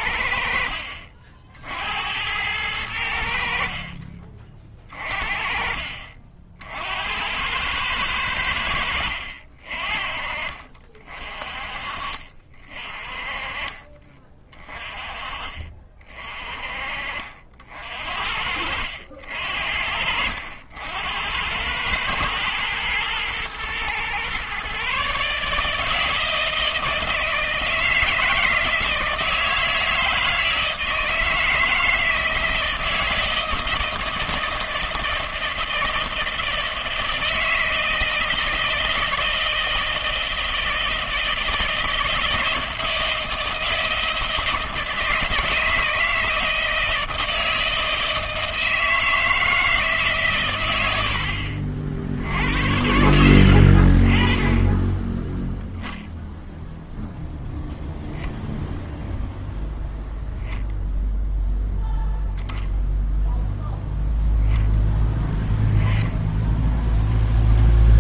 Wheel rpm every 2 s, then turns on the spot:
60, 90, 40, 60, 90, 40, 40, 30, 40, 60, 80, 110, 130, 160, 160, 160, 160, 160, 160, 160, 160, 160, 160, 160, 160, 120, 80, 10, 0, 0, 0, 0, 0, 0.
52-54